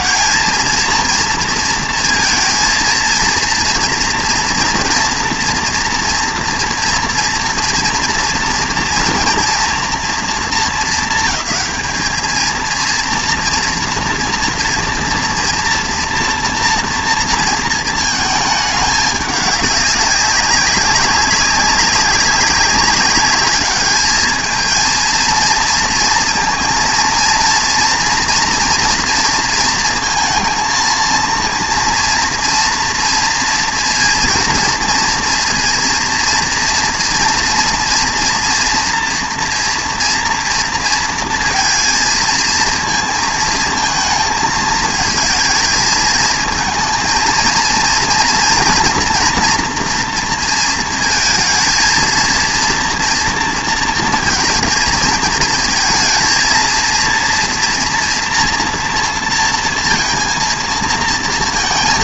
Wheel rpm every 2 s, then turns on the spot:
230, 230, 230, 240, 230, 220, 220, 230, 240, 210, 190, 200, 220, 230, 230, 230, 230, 230, 230, 230, 230, 220, 220, 230, 230, 230, 230, 230, 230, 230, 230.
none